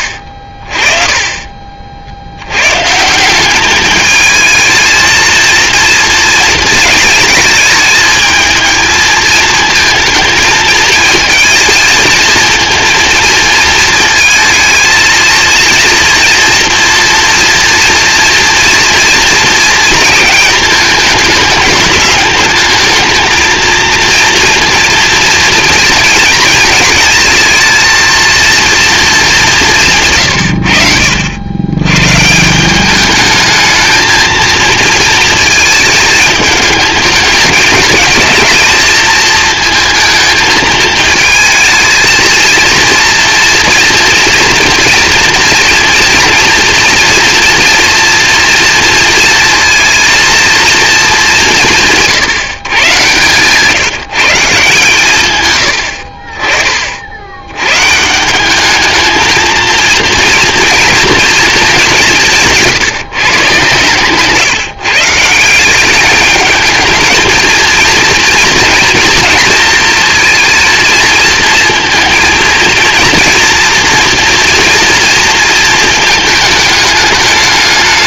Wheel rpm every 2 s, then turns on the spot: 30, 150, 220, 220, 220, 230, 230, 230, 230, 230, 210, 220, 230, 220, 220, 70, 190, 230, 210, 220, 220, 230, 240, 240, 230, 220, 120, 140, 50, 220, 230, 170, 140, 220, 230, 220, 230, 240, 220.
none